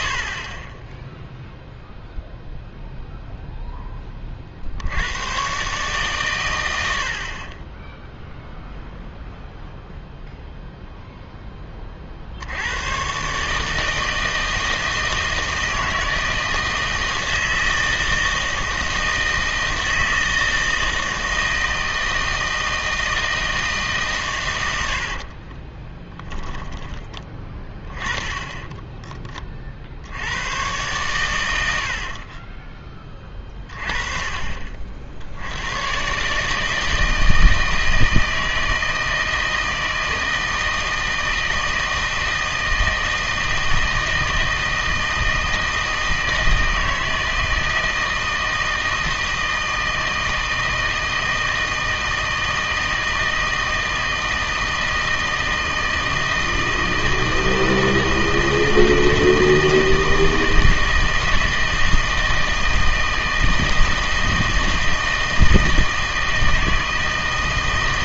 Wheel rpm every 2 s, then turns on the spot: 20, 0, 50, 100, 0, 0, 90, 160, 160, 160, 160, 160, 90, 10, 10, 110, 20, 40, 150, 160, 160, 160, 160, 160, 160, 160, 160, 160, 160, 160, 160, 160, 160, 160.
24-26 28-30